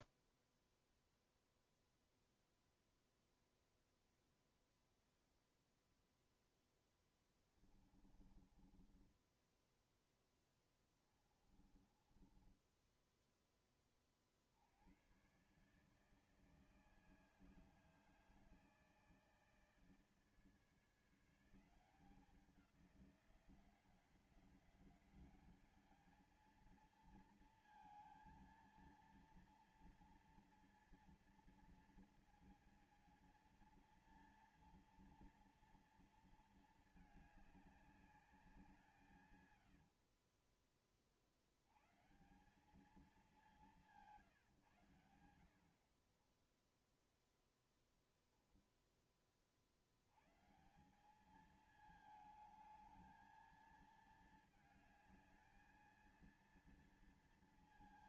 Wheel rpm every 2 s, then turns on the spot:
0, 0, 0, 0, 20, 10, 20, 40, 150, 160, 160, 180, 190, 220, 230, 230, 230, 230, 230, 200, 50, 150, 150, 40, 0, 100, 220, 220, 230.
8-14 46-48